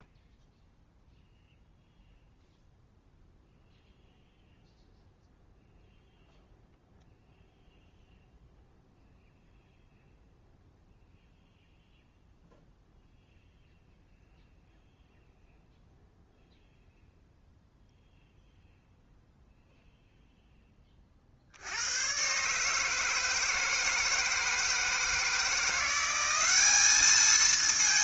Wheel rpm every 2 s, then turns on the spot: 0, 0, 0, 0, 0, 0, 0, 0, 0, 0, 30, 160, 160, 210.
none